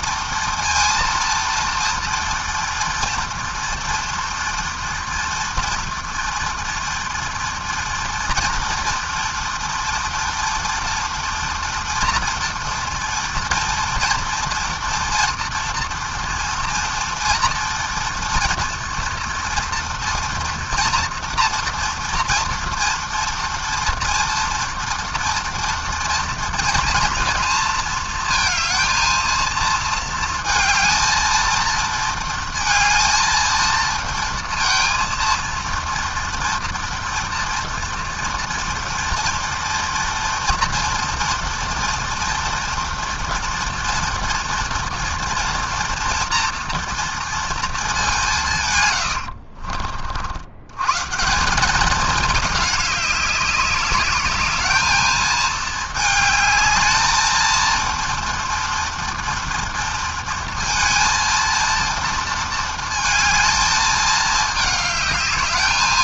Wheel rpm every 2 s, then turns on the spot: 230, 230, 230, 230, 230, 230, 230, 230, 230, 230, 230, 230, 230, 240, 230, 230, 230, 230, 230, 240, 230, 230, 230, 230, 70, 170, 200, 220, 220, 230, 230, 220, 210.
48-50